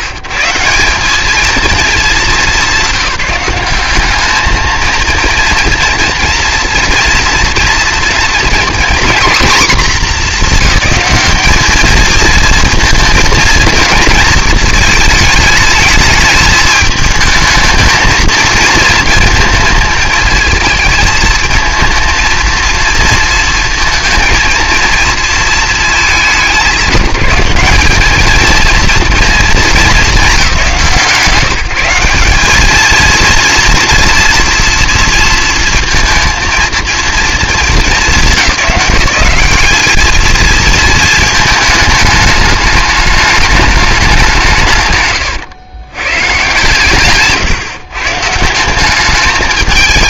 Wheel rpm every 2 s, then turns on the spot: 160, 200, 220, 230, 240, 220, 230, 220, 210, 230, 220, 230, 230, 190, 220, 200, 210, 230, 230, 200, 230, 210, 160, 130, 170.
none